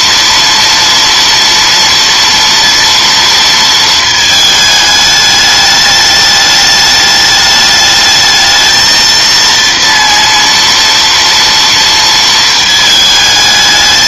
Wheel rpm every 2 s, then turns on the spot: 230, 230, 220, 210, 220, 230, 220.
none